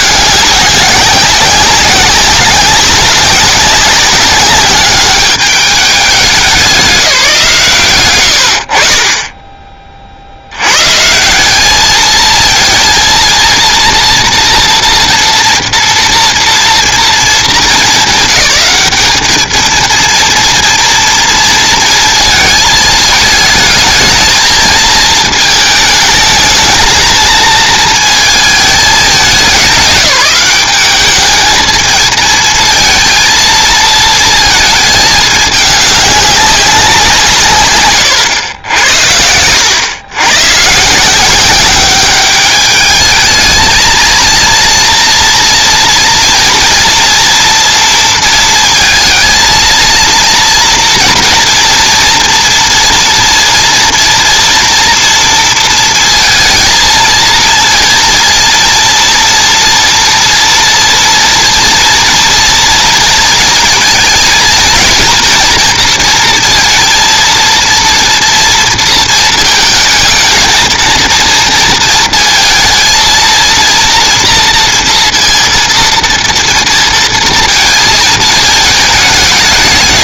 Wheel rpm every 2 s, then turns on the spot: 200, 190, 200, 180, 60, 120, 230, 230, 230, 200, 240, 220, 230, 220, 200, 200, 230, 220, 190, 80, 150, 210, 240, 240, 230, 230, 230, 230, 230, 230, 230, 230, 230, 230, 230, 230, 230, 230, 230, 210.
none